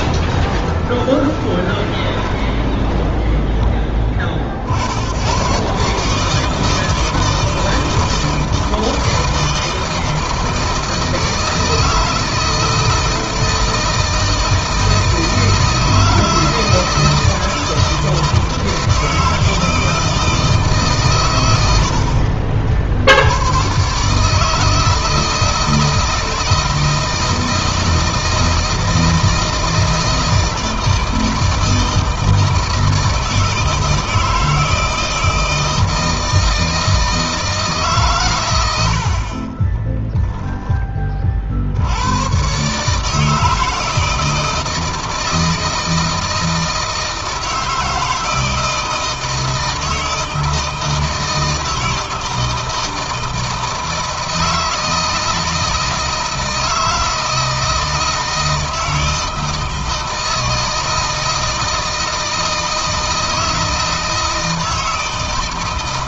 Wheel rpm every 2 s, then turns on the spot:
20, 10, 70, 160, 160, 160, 160, 160, 160, 160, 130, 60, 160, 160, 160, 160, 160, 160, 160, 80, 20, 140, 160, 160, 160, 160, 160, 160, 160, 160, 160, 160, 160.
0-4